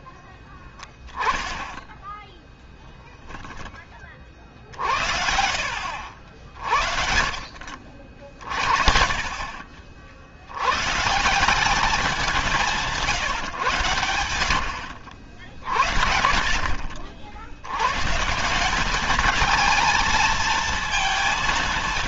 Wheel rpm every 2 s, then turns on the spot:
10, 0, 60, 50, 50, 110, 160, 90, 50, 180, 230.
0-2